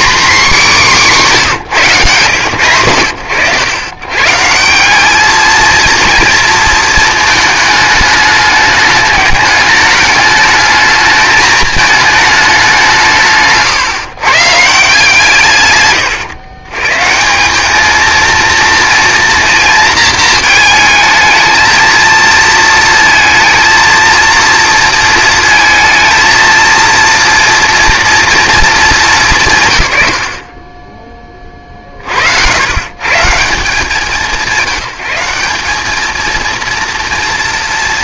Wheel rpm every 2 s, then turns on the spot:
240, 90, 180, 220, 210, 210, 190, 150, 120, 230, 220, 230, 230, 230, 220, 30, 100, 170, 230.
none